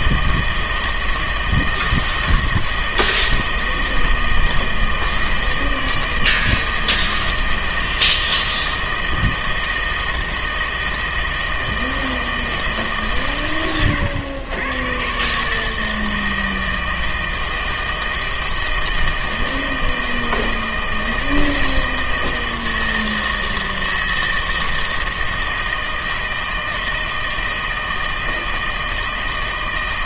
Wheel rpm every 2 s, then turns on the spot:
160, 160, 160, 160, 160, 160, 150, 110, 160, 160, 160, 160, 160, 160, 160.
none